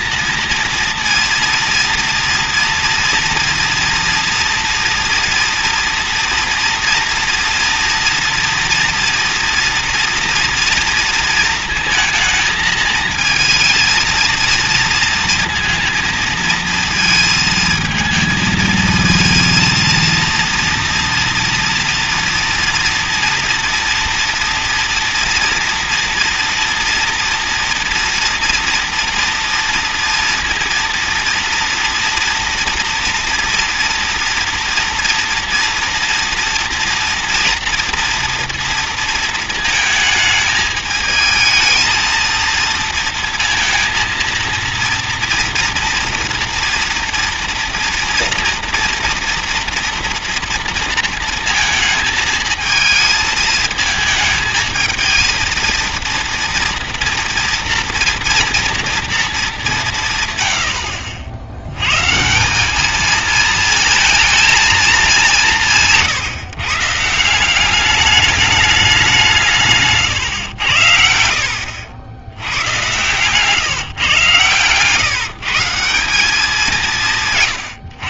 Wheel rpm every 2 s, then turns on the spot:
230, 230, 230, 240, 240, 240, 230, 230, 230, 220, 230, 240, 230, 230, 230, 230, 230, 230, 230, 230, 220, 230, 230, 230, 230, 230, 220, 220, 230, 240, 110, 170, 220, 140, 210, 120, 100, 120, 190.
none